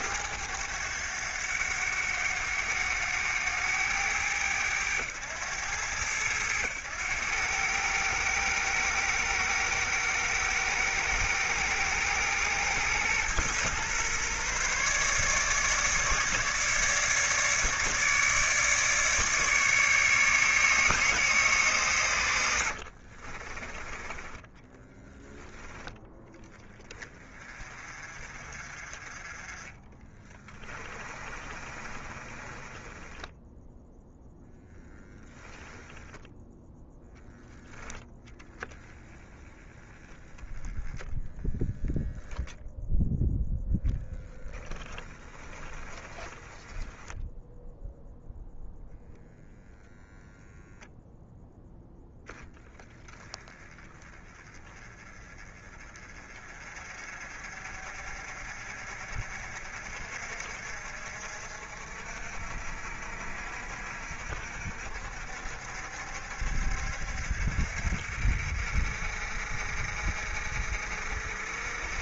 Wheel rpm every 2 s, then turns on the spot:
100, 100, 100, 100, 110, 110, 120, 140, 150, 150, 150, 50, 10, 30, 40, 30, 10, 0, 10, 10, 10, 0, 20, 10, 0, 0, 20, 20, 40, 50, 50, 60, 60, 60, 60, 60.
22-26 28-34 44-48